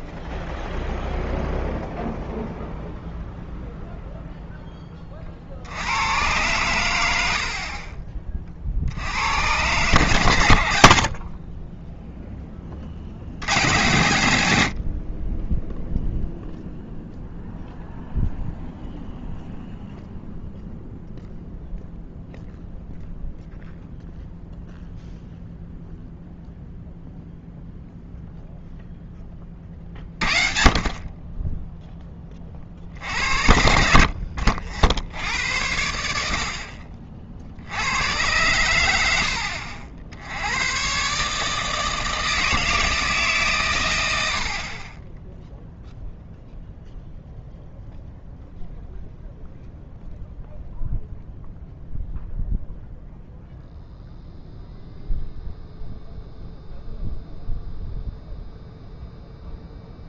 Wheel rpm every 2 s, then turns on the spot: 0, 0, 10, 100, 40, 80, 30, 70, 0, 0, 0, 0, 0, 0, 0, 40, 40, 60, 60, 90, 110, 160, 50, 0, 0, 0, 0, 0, 0, 0.
none